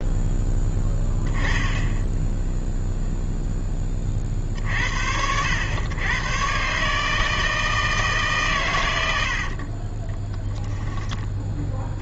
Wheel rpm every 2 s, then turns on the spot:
10, 0, 60, 130, 120, 10.
none